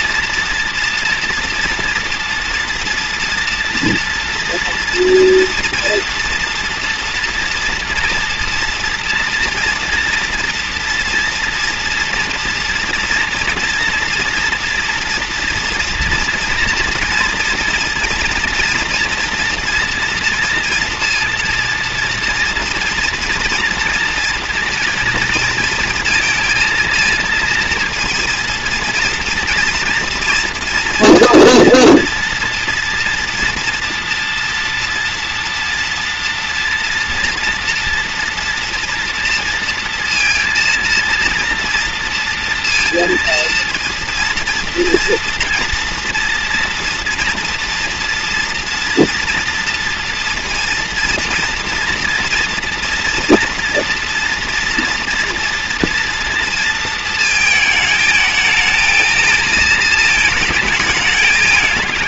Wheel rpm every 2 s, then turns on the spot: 230, 230, 230, 230, 230, 230, 230, 230, 230, 240, 230, 230, 230, 230, 240, 230, 230, 230, 230, 240, 230, 230, 230, 230, 230, 230, 230, 230, 230, 220, 220.
none